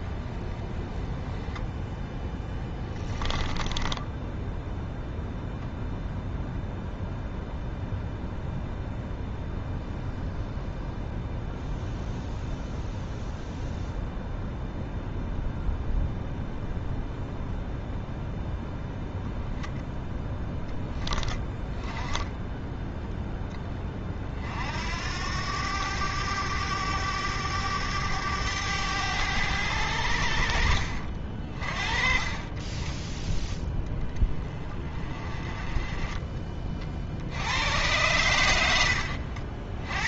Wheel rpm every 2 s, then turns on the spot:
20, 10, 0, 0, 0, 0, 0, 0, 0, 0, 10, 10, 60, 100, 100, 60, 10, 20, 50, 90.
2-4